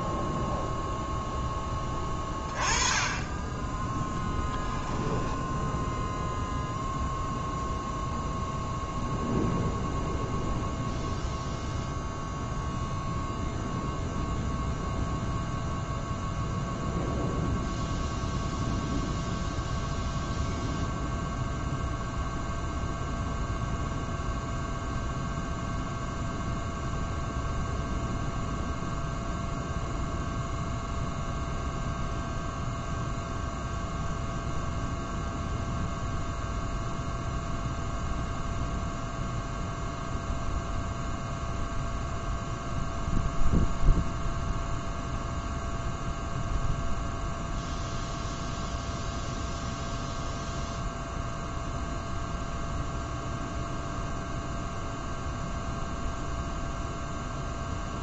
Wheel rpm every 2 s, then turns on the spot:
0, 20, 10, 0, 0, 0, 0, 0, 0, 0, 0, 0, 0, 0, 0, 0, 0, 0, 0, 0, 0, 0, 0, 0, 0, 0, 0, 0, 0.
4-6